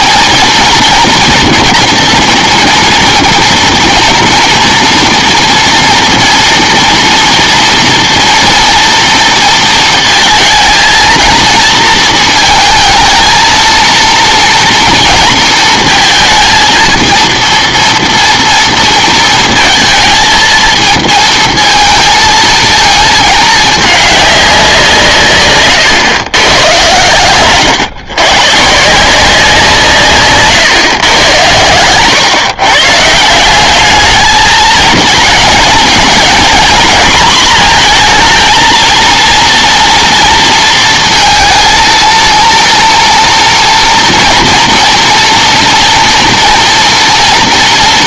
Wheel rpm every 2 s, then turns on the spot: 240, 240, 230, 230, 230, 230, 230, 230, 230, 230, 220, 220, 190, 110, 140, 140, 130, 220, 240, 230, 230, 230, 230, 230.
none